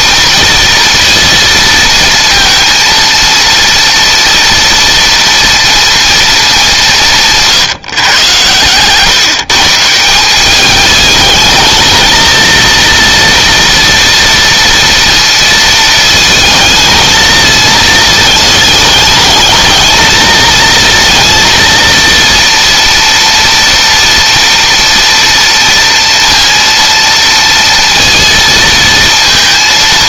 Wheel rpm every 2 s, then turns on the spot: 240, 230, 230, 180, 130, 210, 230, 230, 220, 210, 230, 230, 230, 230, 230.
none